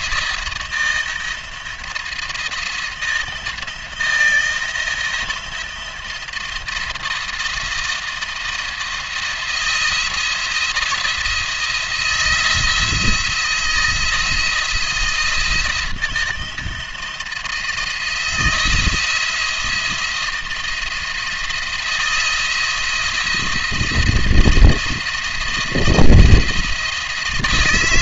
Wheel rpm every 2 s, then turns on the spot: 170, 170, 170, 160, 170, 170, 170, 170, 160, 170, 170, 170, 170, 160.
none